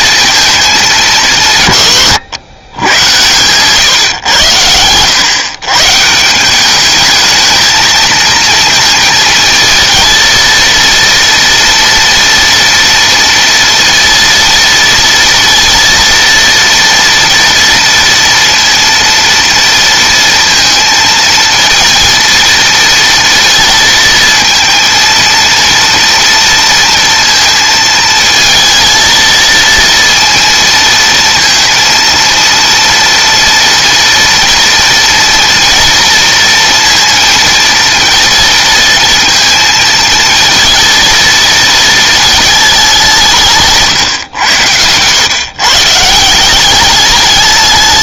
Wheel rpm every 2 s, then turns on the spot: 220, 110, 110, 170, 230, 230, 230, 230, 230, 230, 230, 230, 220, 230, 220, 230, 230, 240, 230, 230, 230, 220, 110, 170.
none